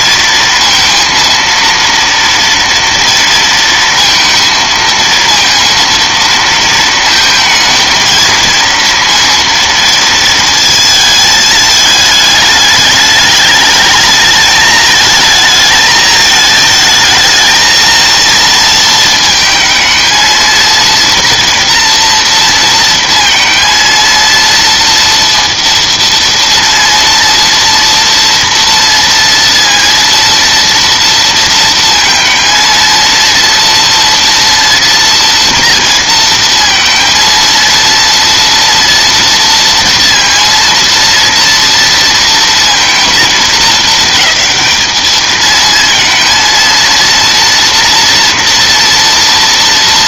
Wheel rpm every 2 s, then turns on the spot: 230, 230, 230, 230, 230, 230, 210, 220, 220, 230, 230, 230, 230, 230, 230, 230, 230, 230, 230, 230, 230, 230, 210, 230, 230.
none